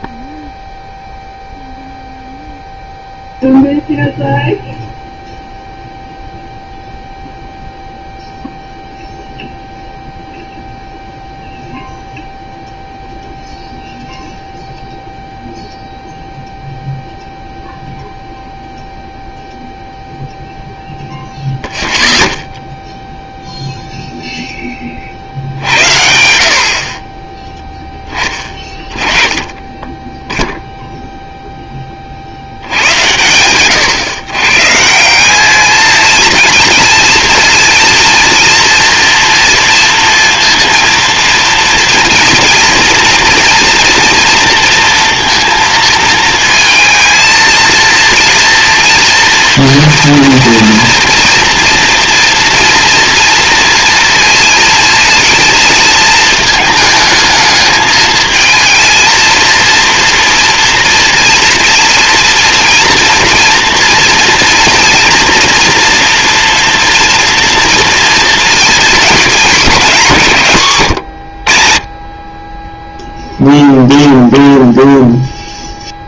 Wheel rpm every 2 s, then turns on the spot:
0, 0, 0, 0, 0, 0, 0, 0, 0, 0, 0, 0, 20, 50, 20, 0, 90, 150, 220, 230, 230, 230, 230, 230, 230, 230, 230, 230, 220, 230, 230, 230, 230, 240, 220, 130, 10, 0.
none